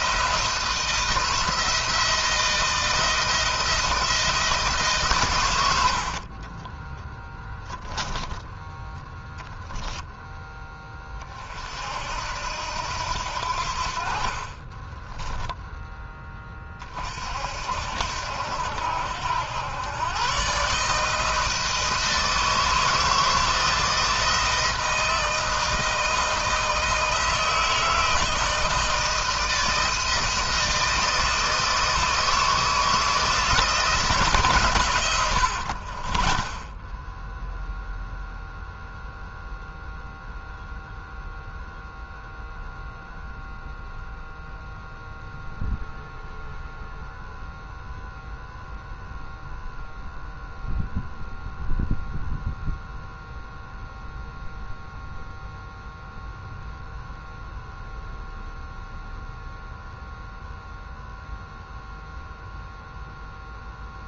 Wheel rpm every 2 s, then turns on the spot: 170, 170, 160, 20, 10, 10, 80, 40, 30, 80, 140, 160, 160, 160, 160, 160, 160, 130, 20, 0, 0, 0, 0, 0, 0, 0, 0, 0, 0, 0, 0, 0.
6-8 14-16 36-38